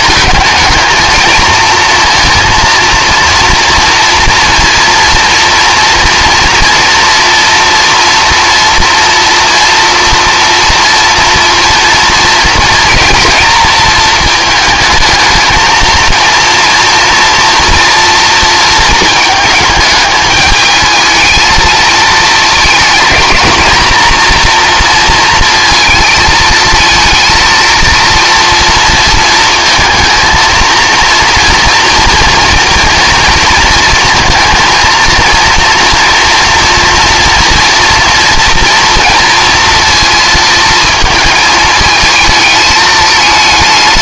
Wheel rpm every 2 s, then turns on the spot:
220, 230, 240, 230, 230, 230, 230, 220, 230, 230, 220, 230, 230, 220, 240, 230, 230, 230, 230, 230, 230, 220.
none